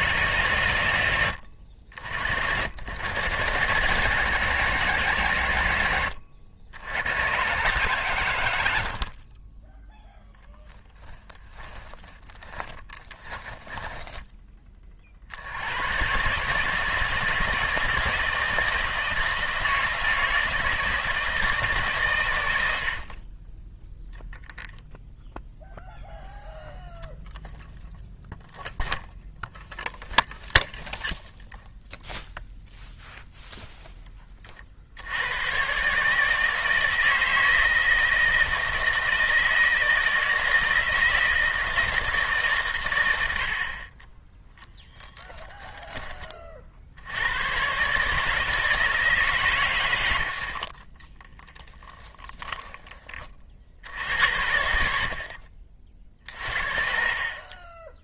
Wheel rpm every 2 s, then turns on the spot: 130, 80, 150, 90, 90, 0, 20, 20, 150, 160, 160, 100, 0, 0, 0, 0, 0, 40, 160, 160, 160, 130, 10, 50, 160, 60, 10, 70, 50.
12-14